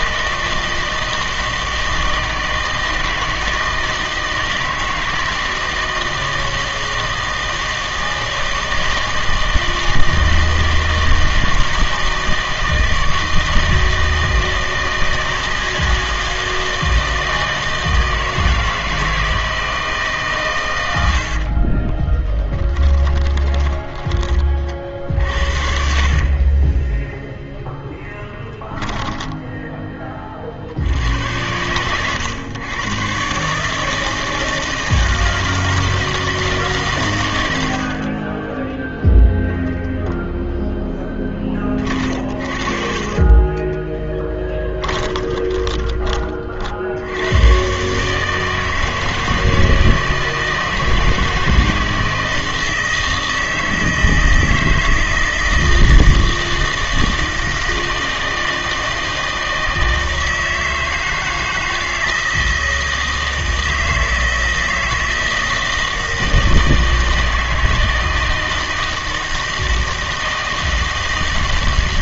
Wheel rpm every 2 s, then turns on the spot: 160, 160, 160, 160, 160, 160, 160, 160, 160, 160, 110, 20, 50, 20, 10, 60, 120, 160, 150, 10, 0, 40, 20, 60, 160, 160, 160, 160, 160, 160, 160, 160, 160, 160, 160, 160.
22-30 38-40 42-46